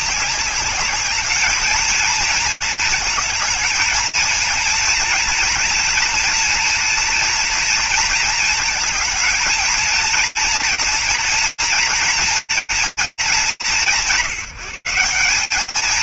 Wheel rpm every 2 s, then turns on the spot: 210, 220, 230, 230, 220, 230, 230, 190.
none